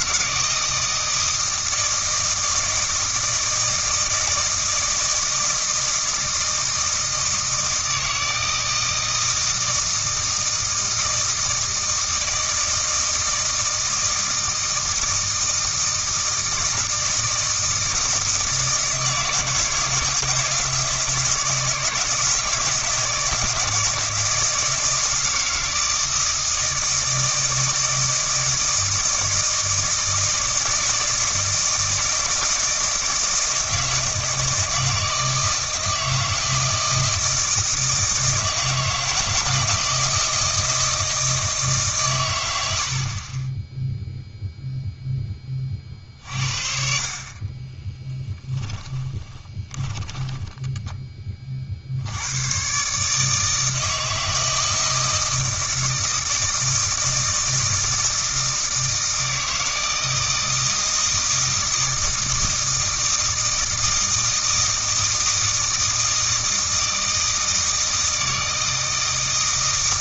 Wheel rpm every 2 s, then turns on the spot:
160, 160, 160, 160, 160, 160, 160, 160, 160, 160, 160, 160, 160, 160, 160, 160, 160, 160, 160, 160, 160, 70, 0, 50, 10, 10, 130, 160, 160, 160, 160, 160, 160, 160, 160.
48-50